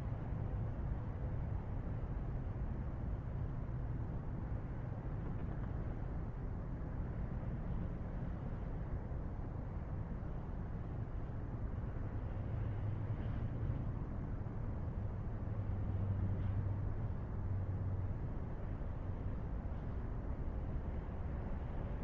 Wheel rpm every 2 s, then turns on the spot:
0, 0, 0, 0, 0, 0, 0, 0, 0, 0, 0.
none